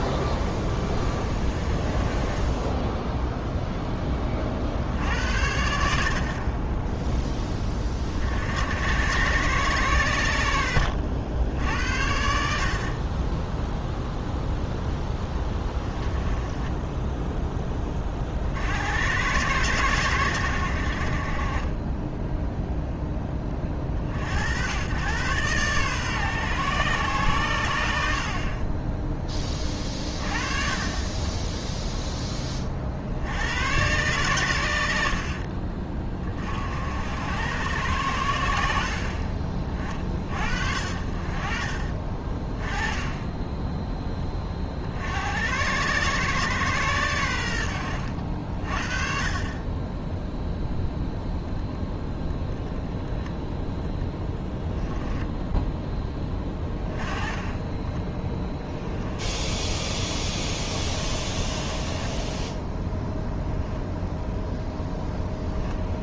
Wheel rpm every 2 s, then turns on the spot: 20, 0, 60, 10, 80, 70, 30, 10, 10, 80, 60, 0, 100, 120, 20, 40, 50, 80, 70, 50, 60, 20, 60, 110, 40, 0, 0, 10, 20, 10, 30, 10, 0.
14-18 56-58 60-62